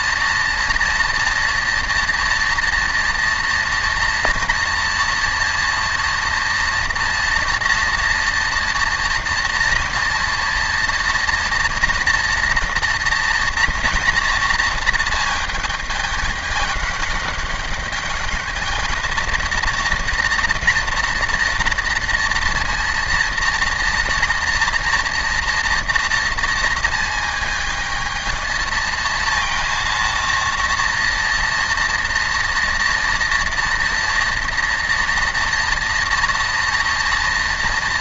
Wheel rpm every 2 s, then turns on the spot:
230, 230, 230, 230, 230, 230, 230, 230, 200, 220, 240, 230, 230, 230, 230, 230, 230, 230, 230.
none